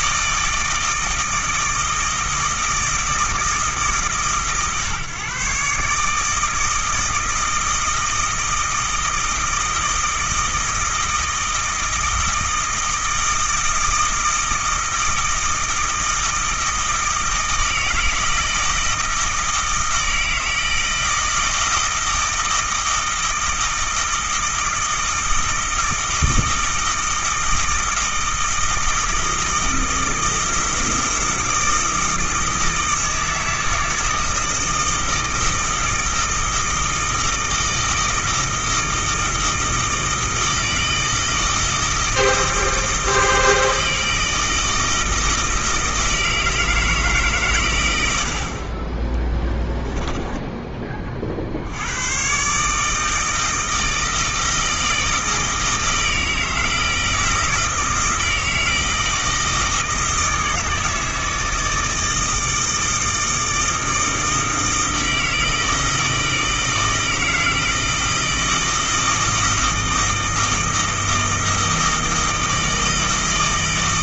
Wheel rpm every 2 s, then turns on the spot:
160, 160, 140, 160, 160, 160, 160, 160, 160, 160, 160, 160, 160, 160, 160, 160, 160, 160, 160, 160, 160, 160, 160, 160, 40, 20, 140, 160, 160, 160, 160, 160, 160, 160, 160, 160, 160.
none